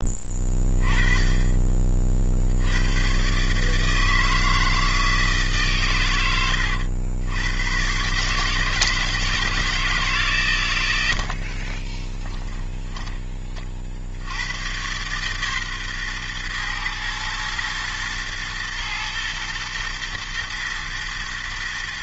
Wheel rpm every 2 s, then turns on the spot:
20, 90, 160, 80, 150, 110, 10, 110, 110, 110, 110.
none